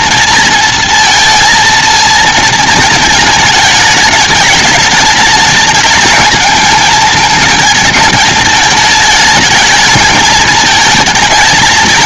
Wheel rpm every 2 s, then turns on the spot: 230, 230, 210, 220, 230, 220.
none